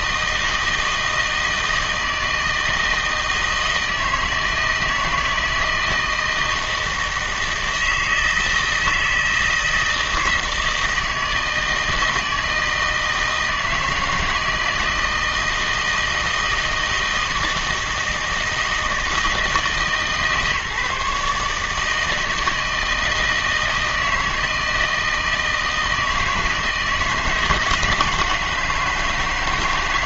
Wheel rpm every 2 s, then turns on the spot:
160, 160, 160, 160, 160, 160, 160, 160, 160, 160, 150, 160, 160, 160, 160.
none